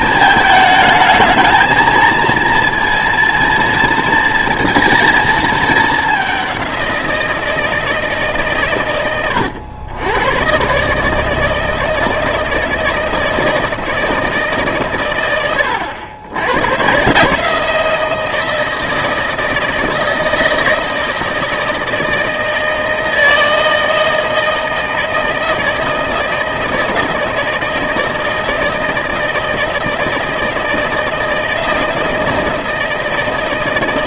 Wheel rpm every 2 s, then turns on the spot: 220, 230, 230, 190, 130, 130, 160, 140, 110, 160, 160, 160, 160, 160, 160, 160, 160.
none